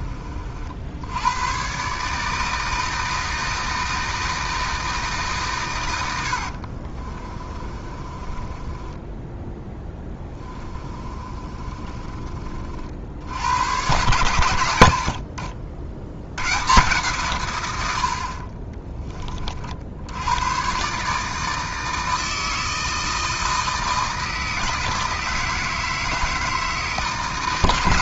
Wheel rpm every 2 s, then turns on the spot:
70, 160, 160, 40, 20, 20, 50, 80, 140, 20, 130, 160, 160, 150.
6-12 18-20